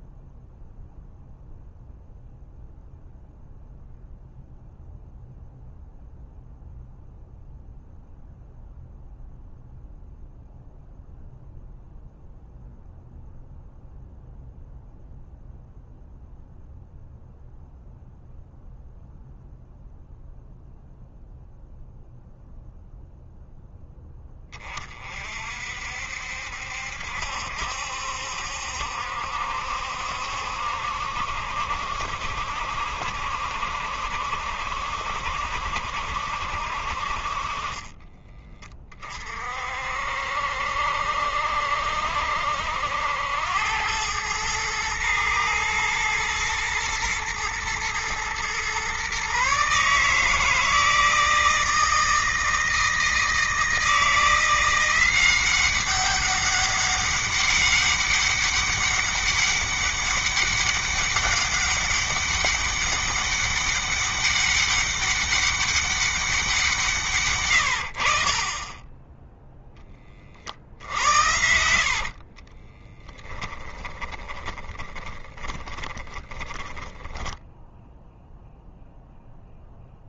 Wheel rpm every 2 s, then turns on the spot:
0, 0, 0, 0, 0, 0, 0, 0, 0, 0, 0, 0, 30, 70, 70, 70, 70, 60, 50, 30, 60, 80, 110, 110, 130, 160, 160, 180, 200, 200, 200, 200, 200, 150, 10, 70, 30, 20, 10, 0.
70-76